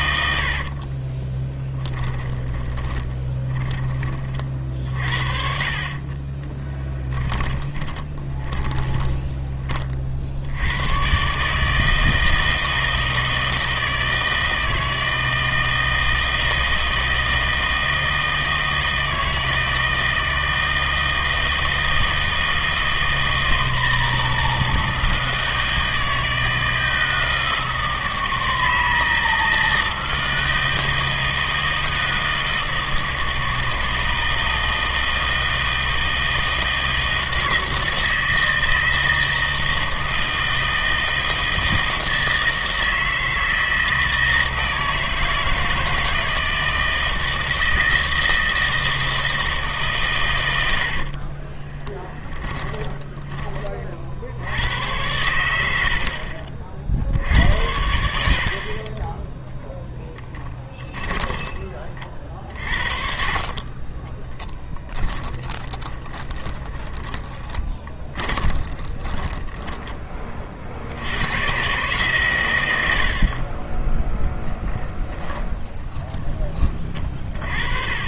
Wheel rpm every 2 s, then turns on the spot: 50, 20, 50, 20, 20, 100, 160, 160, 160, 160, 160, 160, 160, 160, 160, 160, 160, 160, 160, 160, 160, 160, 160, 160, 160, 80, 20, 90, 60, 30, 10, 40, 10, 20, 20, 50, 90, 10, 30.
0-4 6-10 50-54 60-62 64-70 74-76